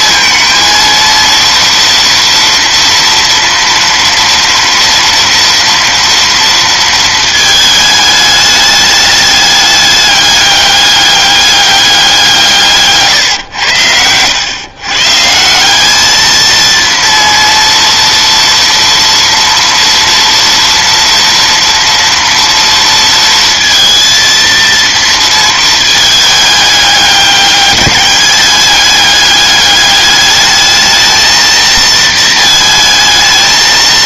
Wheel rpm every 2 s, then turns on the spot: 230, 230, 230, 220, 210, 200, 140, 140, 230, 230, 230, 230, 230, 200, 200, 220, 220.
none